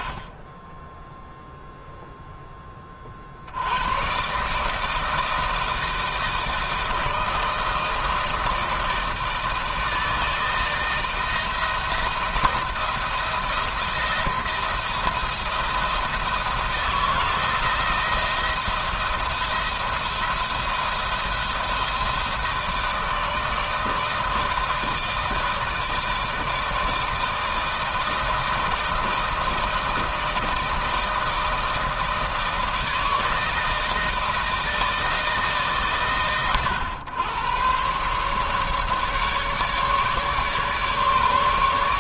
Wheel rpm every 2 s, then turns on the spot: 10, 30, 150, 160, 160, 160, 170, 170, 160, 160, 170, 160, 160, 160, 160, 160, 160, 160, 110, 140, 150.
none